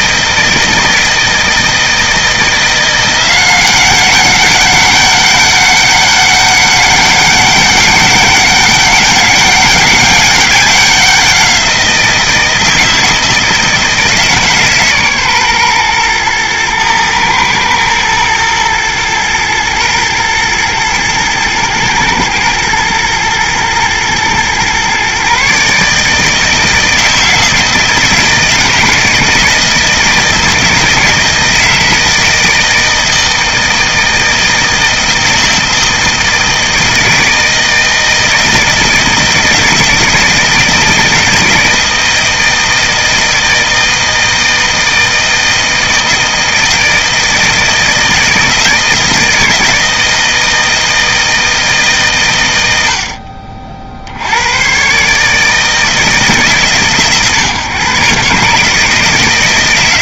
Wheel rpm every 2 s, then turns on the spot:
160, 170, 200, 200, 200, 200, 160, 140, 110, 120, 110, 120, 130, 160, 160, 160, 160, 160, 160, 160, 160, 160, 160, 160, 160, 160, 80, 120, 140, 160.
none